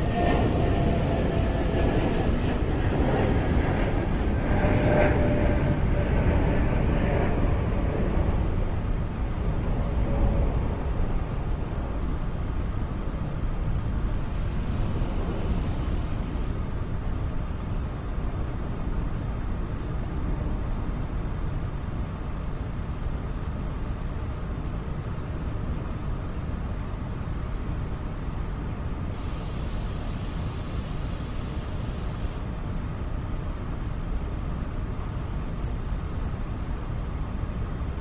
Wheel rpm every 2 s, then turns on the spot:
0, 0, 0, 0, 0, 0, 0, 0, 0, 0, 0, 0, 0, 0, 0, 0, 0, 0, 0.
none